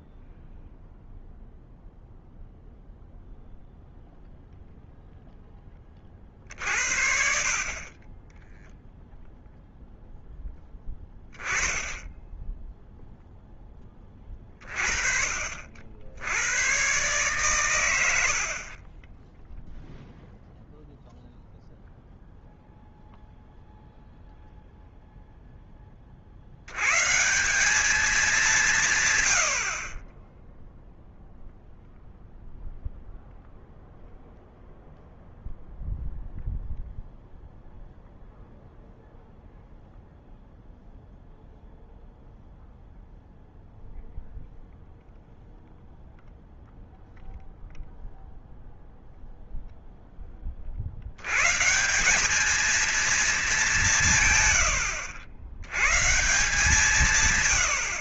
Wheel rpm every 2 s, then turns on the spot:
0, 0, 0, 60, 0, 10, 10, 50, 120, 40, 0, 0, 0, 80, 160, 10, 0, 0, 0, 0, 0, 0, 0, 0, 0, 40, 210, 150, 130.
none